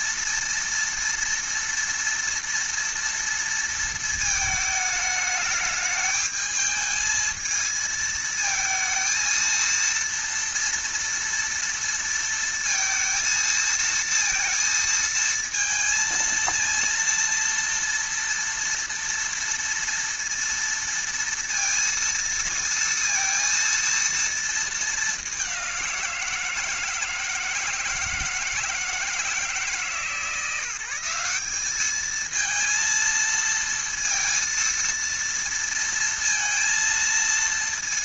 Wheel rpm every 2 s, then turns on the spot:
230, 230, 220, 220, 220, 230, 230, 230, 230, 230, 230, 230, 220, 160, 160, 160, 230, 230, 230.
none